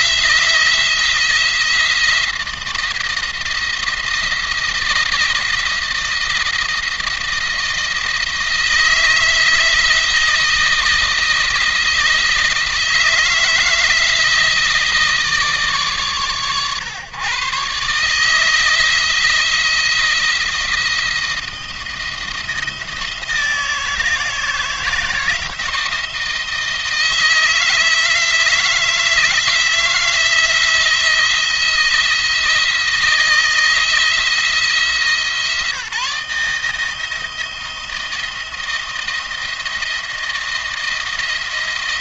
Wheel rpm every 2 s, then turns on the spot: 170, 170, 170, 170, 160, 170, 170, 160, 120, 160, 170, 160, 160, 160, 160, 170, 160, 160, 160, 160, 170.
none